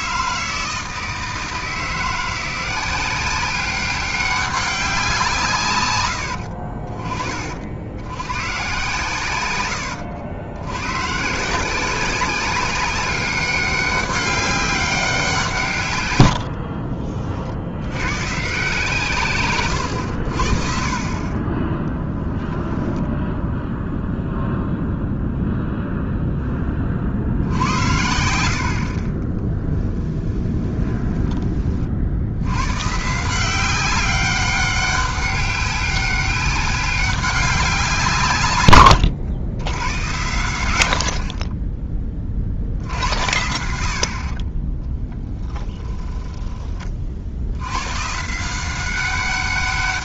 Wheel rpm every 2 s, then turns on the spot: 160, 180, 190, 60, 120, 100, 200, 200, 50, 140, 40, 0, 0, 30, 60, 20, 110, 190, 200, 110, 90, 60, 20, 30, 180.
16-18 30-32 38-40